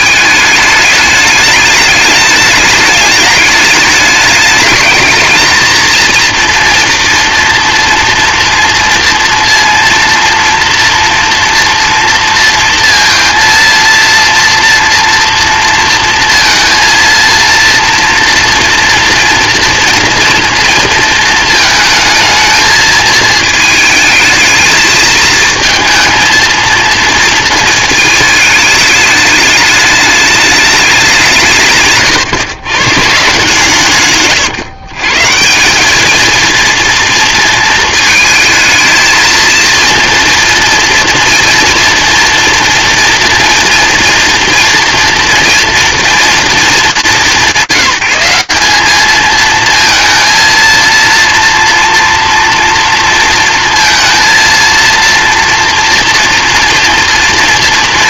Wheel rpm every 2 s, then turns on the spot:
220, 210, 210, 230, 230, 230, 230, 230, 230, 230, 230, 220, 220, 230, 220, 210, 120, 140, 230, 220, 230, 230, 230, 200, 200, 230, 230, 230, 230.
none